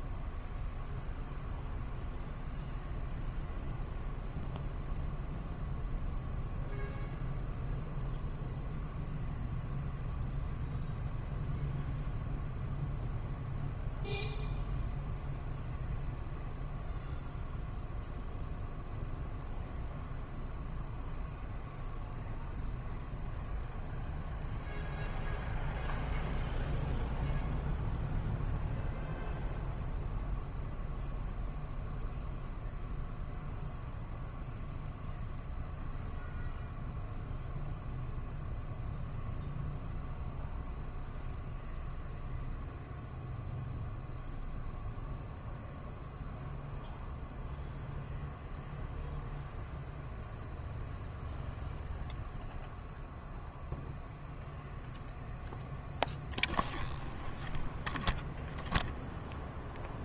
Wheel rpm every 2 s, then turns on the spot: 0, 0, 0, 0, 0, 0, 0, 0, 0, 0, 0, 0, 0, 0, 0, 0, 0, 0, 0, 0, 0, 0, 0, 0, 0, 0, 0, 0, 0, 0.
none